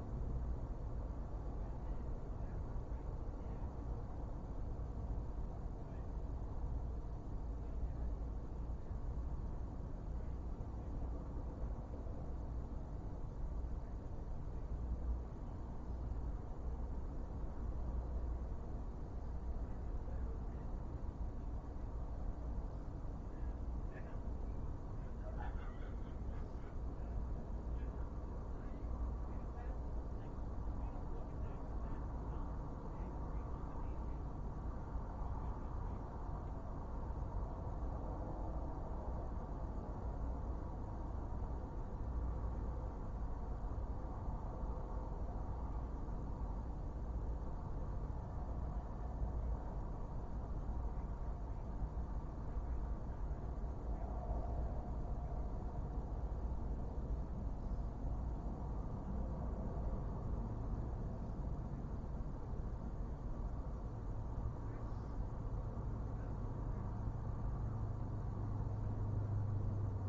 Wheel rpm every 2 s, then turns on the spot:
0, 0, 0, 0, 0, 0, 0, 0, 0, 0, 0, 0, 0, 0, 0, 0, 0, 0, 0, 0, 0, 0, 0, 0, 0, 0, 0, 0, 0, 0, 0, 0, 0, 0, 0.
none